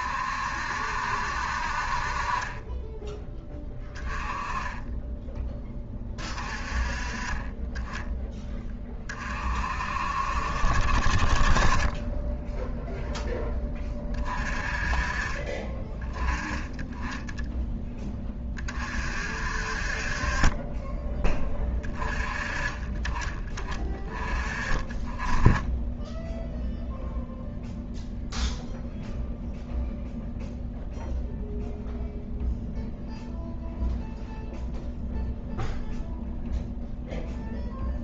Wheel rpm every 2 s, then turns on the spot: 60, 20, 10, 30, 20, 50, 0, 30, 10, 40, 20, 40, 20, 0, 0, 0, 0, 0, 0.
none